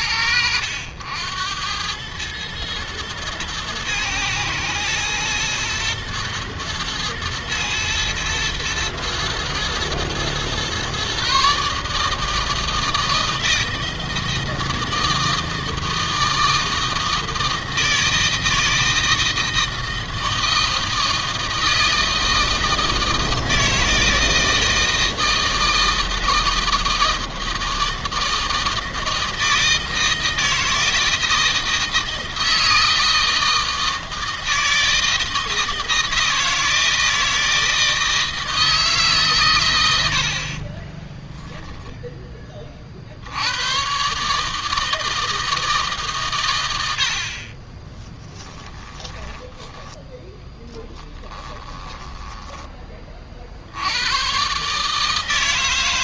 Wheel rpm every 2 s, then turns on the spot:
90, 110, 110, 110, 120, 130, 160, 160, 160, 160, 160, 160, 160, 160, 160, 160, 160, 160, 160, 150, 40, 30, 160, 90, 10, 10, 20, 150.
40-42 48-52